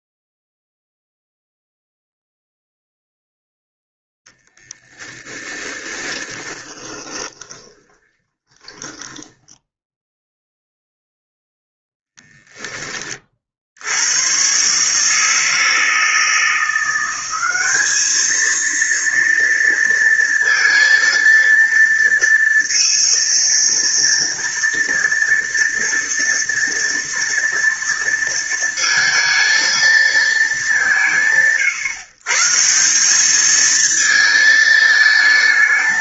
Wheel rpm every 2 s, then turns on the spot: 0, 0, 10, 20, 10, 0, 30, 150, 180, 230, 230, 230, 240, 230, 230, 130, 190, 220.
6-10